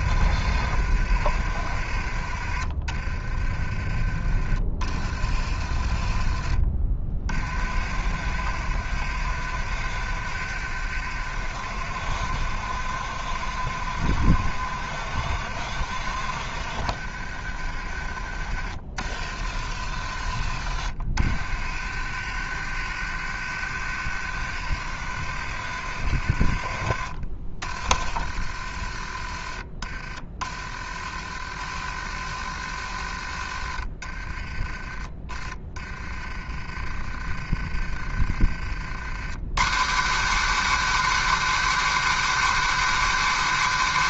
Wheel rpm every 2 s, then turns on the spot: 60, 40, 50, 40, 60, 60, 60, 60, 50, 50, 50, 60, 60, 40, 40, 40, 50, 20, 30, 50, 150, 150.
2-4